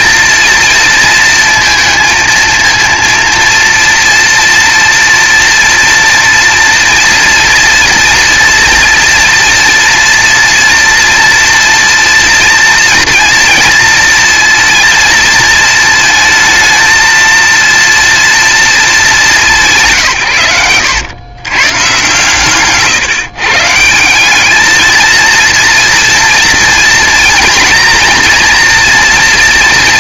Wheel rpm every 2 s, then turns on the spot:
230, 230, 230, 230, 230, 230, 230, 230, 230, 210, 100, 140, 220, 230, 230.
none